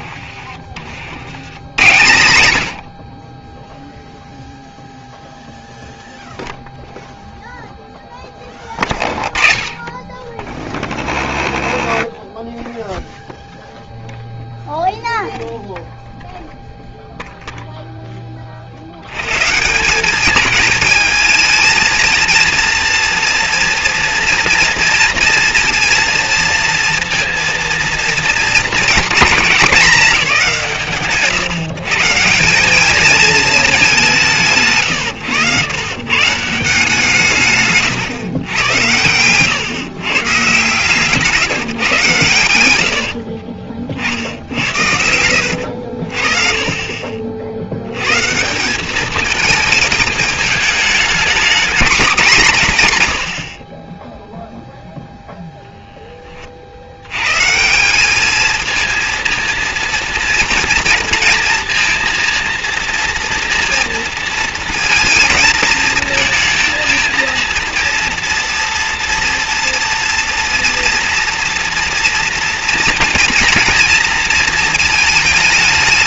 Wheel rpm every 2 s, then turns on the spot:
110, 10, 0, 0, 20, 0, 0, 0, 0, 140, 220, 230, 230, 230, 220, 130, 220, 110, 140, 110, 140, 40, 70, 40, 210, 220, 140, 0, 60, 220, 230, 230, 230, 220, 230, 240, 230, 220.
42-46